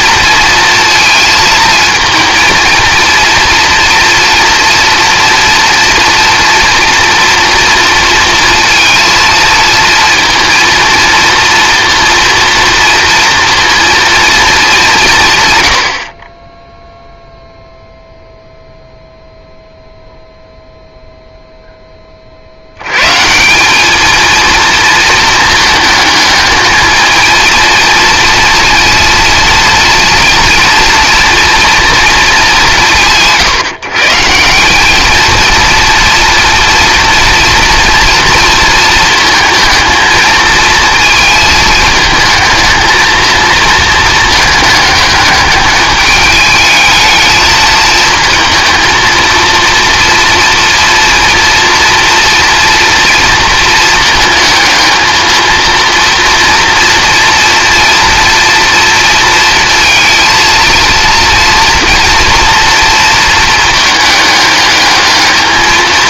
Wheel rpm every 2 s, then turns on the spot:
230, 230, 230, 230, 220, 230, 230, 180, 0, 0, 0, 130, 220, 220, 230, 230, 170, 210, 230, 220, 220, 220, 210, 210, 230, 230, 230, 220, 230, 230, 230, 230, 210.
none